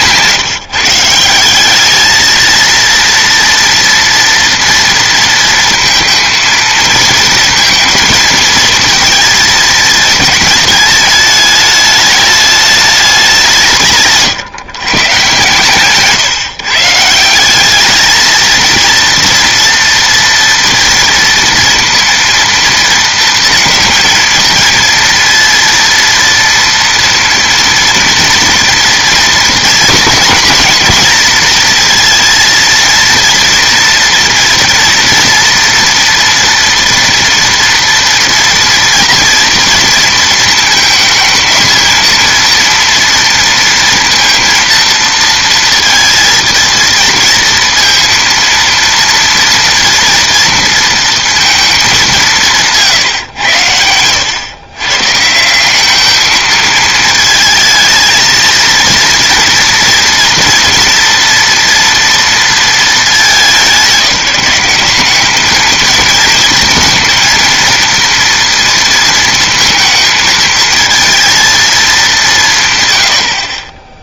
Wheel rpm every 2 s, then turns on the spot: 160, 230, 240, 220, 230, 210, 210, 140, 140, 230, 230, 230, 230, 230, 230, 230, 230, 230, 240, 230, 220, 230, 230, 230, 230, 230, 160, 130, 220, 230, 230, 210, 190, 230, 230, 220, 140.
none